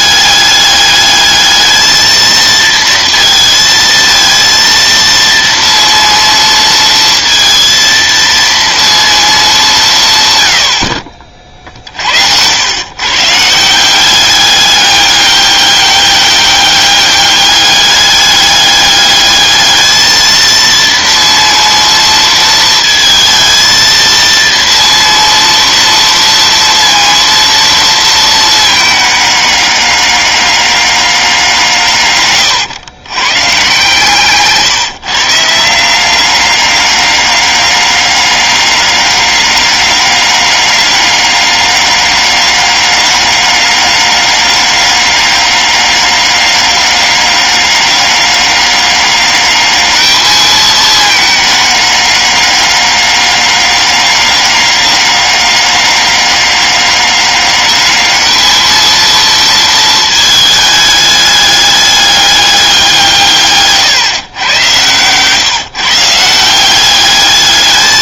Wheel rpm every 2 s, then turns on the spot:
210, 230, 230, 230, 230, 110, 100, 200, 200, 200, 230, 230, 230, 230, 220, 200, 120, 150, 200, 200, 200, 200, 200, 200, 200, 220, 200, 200, 200, 220, 220, 190, 120, 180.
none